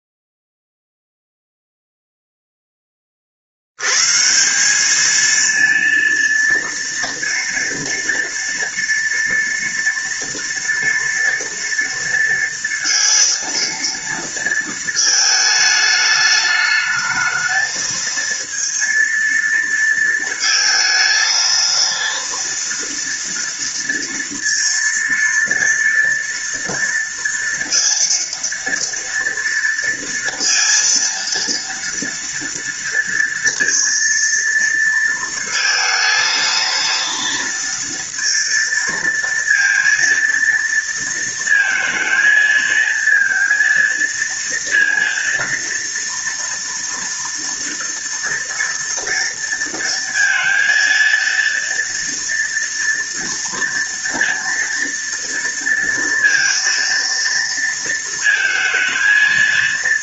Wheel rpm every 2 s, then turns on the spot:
0, 20, 210, 230, 230, 230, 230, 220, 210, 230, 230, 230, 230, 230, 230, 230, 230, 230, 230, 230, 230, 230, 230, 230, 230, 230, 240, 230, 230, 220.
none